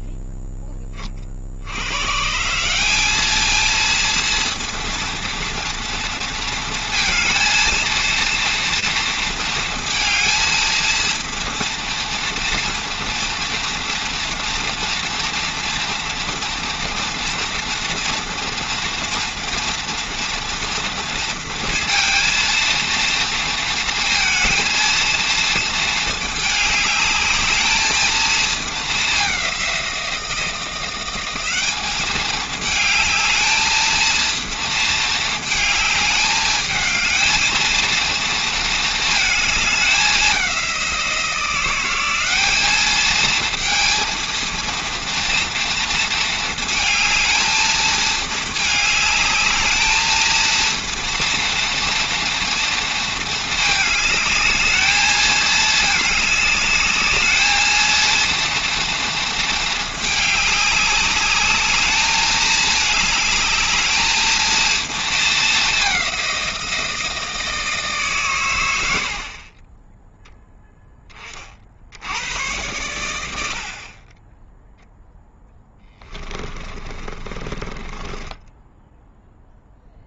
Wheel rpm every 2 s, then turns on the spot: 20, 210, 230, 230, 230, 230, 230, 230, 230, 230, 230, 230, 230, 210, 200, 190, 220, 220, 220, 220, 170, 220, 230, 220, 210, 230, 230, 210, 210, 230, 200, 220, 220, 160, 80, 10, 90, 0, 30, 10.
76-80